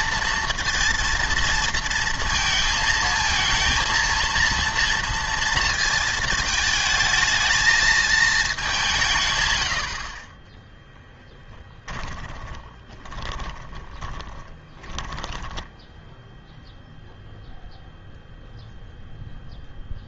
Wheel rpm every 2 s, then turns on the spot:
230, 220, 230, 220, 190, 10, 20, 10, 0, 0.
10-16